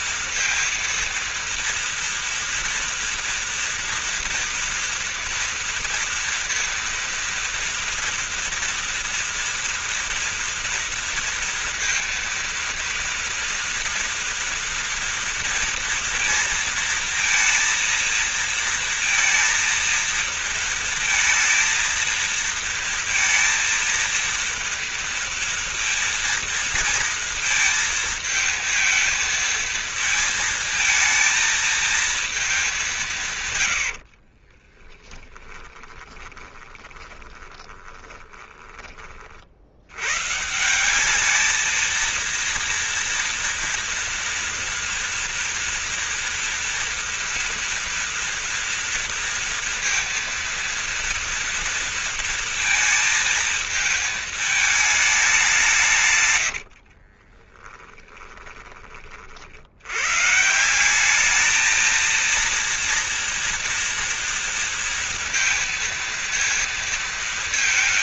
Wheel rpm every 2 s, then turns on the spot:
230, 230, 230, 230, 230, 230, 230, 240, 230, 230, 230, 230, 230, 230, 220, 230, 220, 40, 20, 20, 120, 230, 230, 240, 230, 230, 230, 220, 120, 20, 130, 230, 230, 230.
34-40 56-60